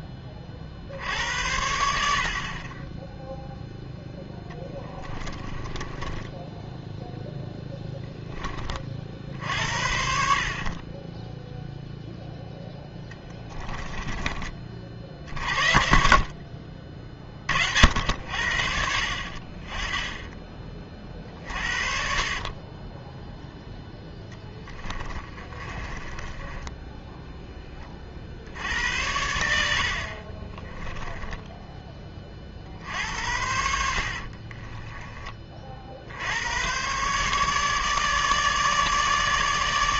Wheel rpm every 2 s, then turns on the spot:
50, 20, 10, 10, 30, 40, 10, 40, 40, 70, 30, 20, 20, 20, 70, 10, 60, 30, 110, 150.
4-8 24-28 30-32 34-36